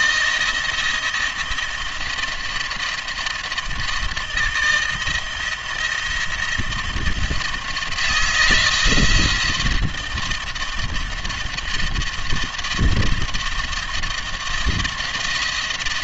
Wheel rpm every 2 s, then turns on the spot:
170, 170, 160, 170, 170, 170, 170, 170.
none